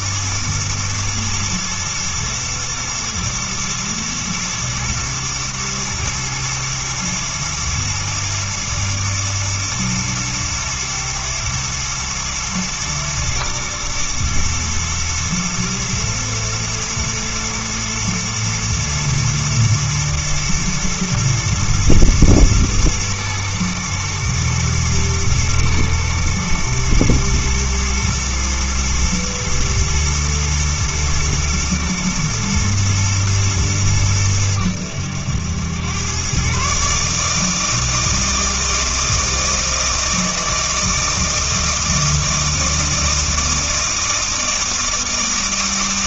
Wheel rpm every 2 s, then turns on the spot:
120, 120, 110, 110, 120, 120, 110, 110, 120, 110, 120, 110, 120, 120, 120, 110, 110, 100, 130, 160, 160, 160, 160.
none